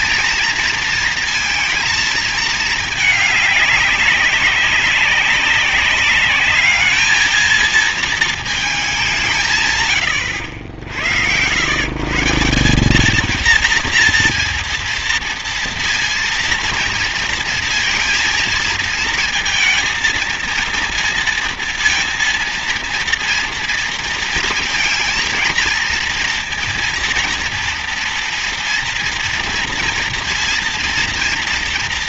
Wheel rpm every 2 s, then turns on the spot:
230, 220, 200, 210, 220, 80, 170, 230, 230, 230, 230, 230, 220, 230, 230, 230.
none